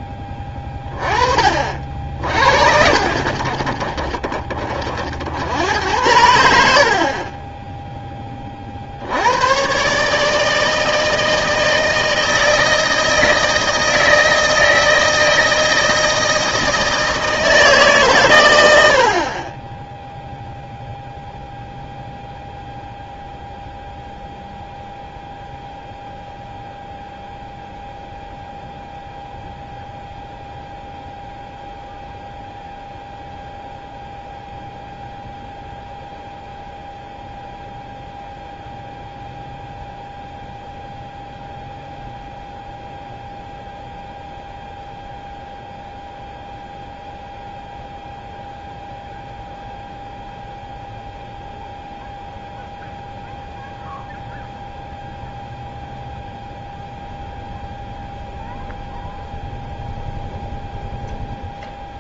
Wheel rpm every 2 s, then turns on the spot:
10, 70, 30, 90, 30, 160, 170, 160, 160, 110, 0, 0, 0, 0, 0, 0, 0, 0, 0, 0, 0, 0, 0, 0, 0, 0, 0, 0, 0, 0, 0.
none